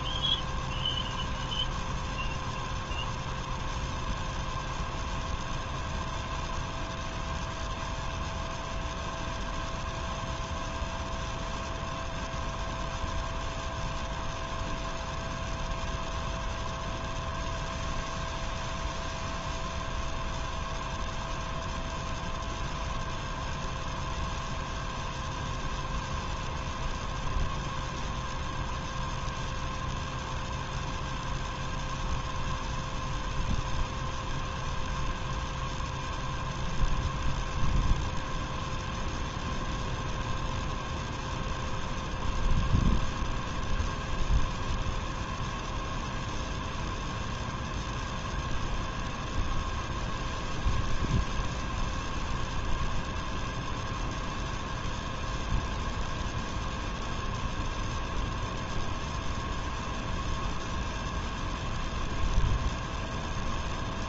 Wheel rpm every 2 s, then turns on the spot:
0, 0, 0, 0, 0, 0, 0, 0, 0, 0, 0, 0, 0, 0, 0, 0, 0, 0, 0, 0, 0, 0, 0, 0, 0, 0, 0, 0, 0, 0, 0, 0.
none